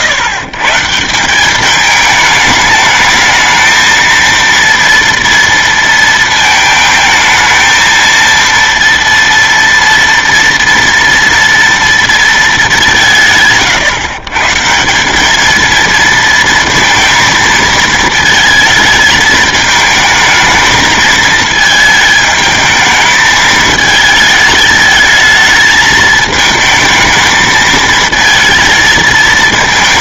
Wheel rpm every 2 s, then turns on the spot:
130, 210, 230, 220, 230, 240, 200, 170, 230, 220, 220, 220, 220, 220, 220.
none